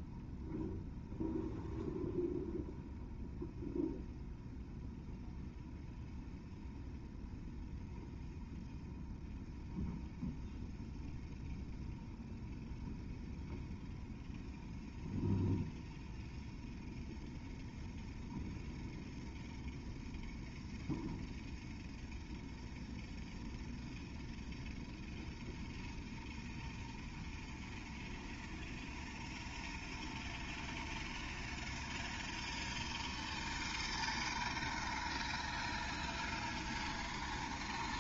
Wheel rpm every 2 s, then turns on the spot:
0, 0, 0, 0, 0, 0, 0, 0, 0, 0, 0, 0, 0, 0, 0, 0, 0, 0, 0.
none